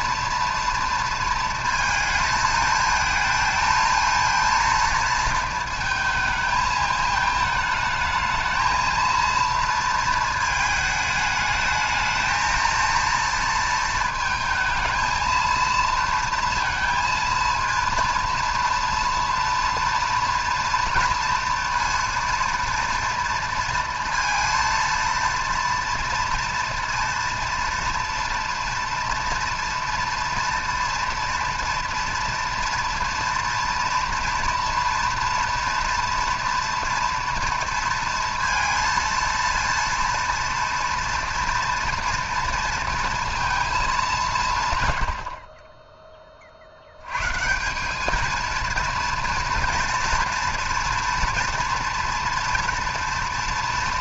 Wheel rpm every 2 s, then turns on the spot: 230, 220, 230, 220, 230, 220, 230, 220, 230, 230, 230, 230, 230, 230, 230, 230, 230, 230, 240, 230, 230, 230, 130, 70, 230, 240, 230.
none